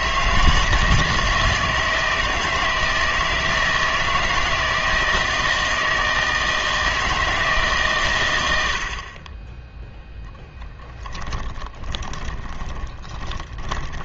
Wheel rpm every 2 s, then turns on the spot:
160, 160, 160, 160, 70, 10, 20.
10-14